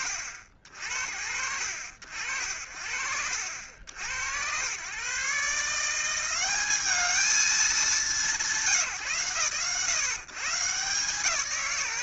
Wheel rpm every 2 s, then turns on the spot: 50, 50, 120, 200, 170, 150.
none